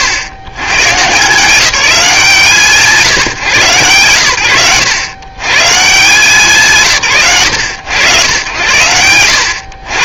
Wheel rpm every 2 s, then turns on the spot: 130, 160, 110, 160, 100.
none